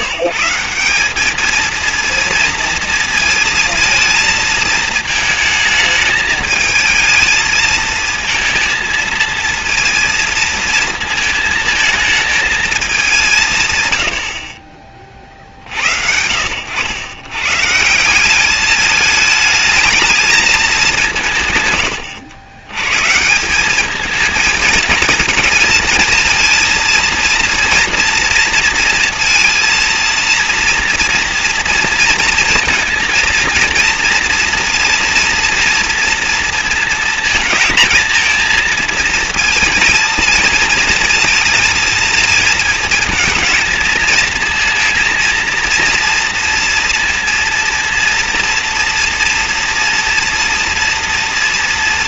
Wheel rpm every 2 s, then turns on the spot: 160, 230, 220, 220, 220, 220, 220, 60, 80, 200, 210, 90, 220, 230, 230, 230, 230, 230, 230, 220, 230, 220, 220, 230, 230, 230.
none